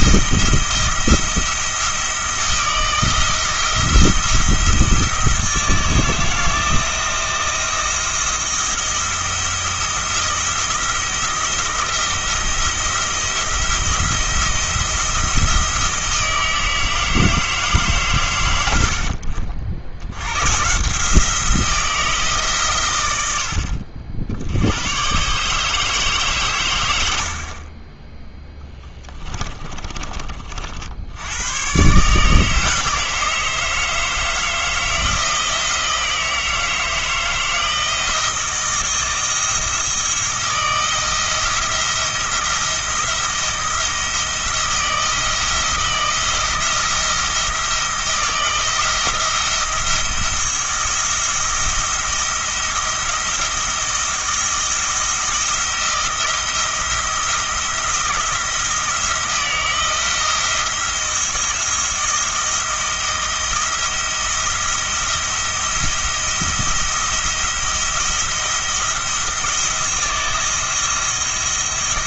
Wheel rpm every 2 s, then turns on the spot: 170, 160, 160, 160, 170, 170, 170, 170, 160, 80, 150, 120, 100, 100, 10, 50, 160, 160, 160, 170, 160, 170, 170, 160, 170, 170, 170, 170, 170, 170, 170, 170, 170, 170, 170, 160.
28-30